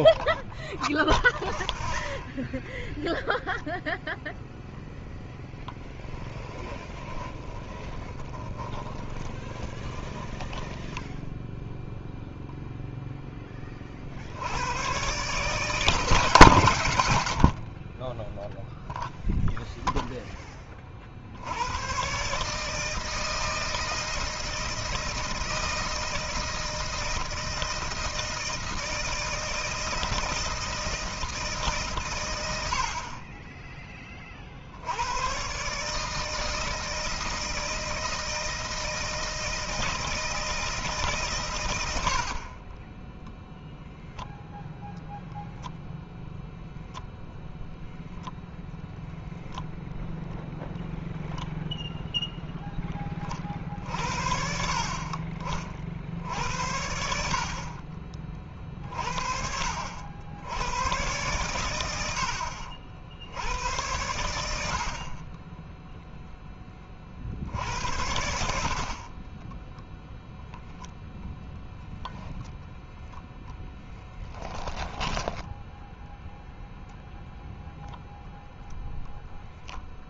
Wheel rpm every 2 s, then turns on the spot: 0, 0, 0, 10, 10, 10, 0, 110, 120, 0, 30, 160, 160, 160, 160, 160, 80, 80, 160, 160, 160, 30, 0, 0, 0, 0, 10, 50, 70, 30, 100, 60, 70, 20, 50, 0, 0, 20, 0, 0.
6-12 74-76